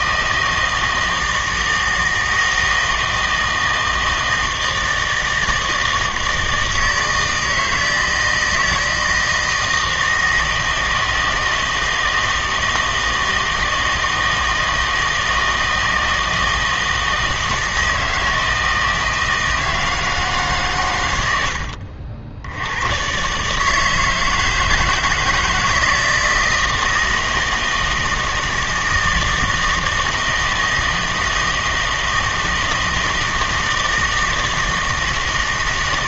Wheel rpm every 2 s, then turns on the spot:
160, 160, 160, 160, 160, 160, 160, 160, 160, 160, 140, 90, 160, 160, 160, 160, 160, 160.
none